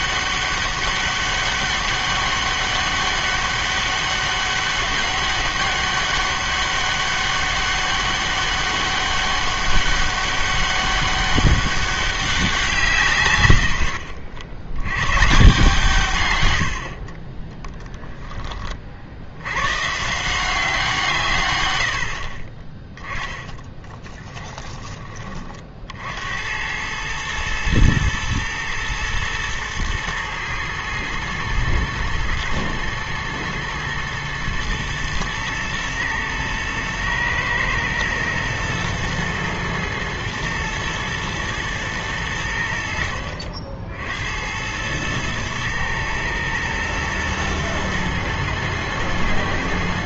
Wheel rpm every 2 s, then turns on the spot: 200, 200, 200, 200, 200, 200, 170, 80, 100, 20, 170, 30, 10, 90, 110, 110, 120, 110, 110, 120, 110, 80, 90, 120, 110.
24-26